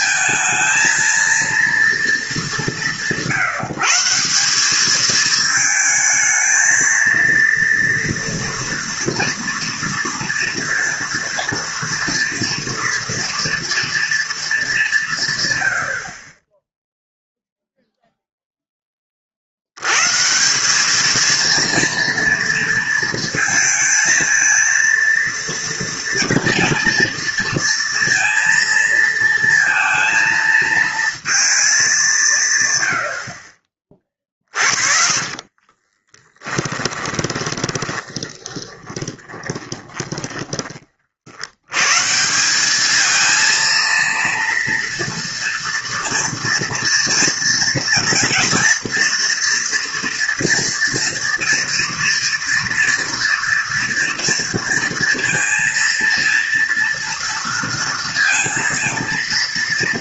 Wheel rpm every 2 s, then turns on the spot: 230, 170, 190, 220, 240, 230, 240, 200, 10, 10, 190, 230, 230, 230, 230, 230, 110, 30, 20, 20, 40, 200, 230, 230, 230, 230, 230, 230, 230, 230.
34-40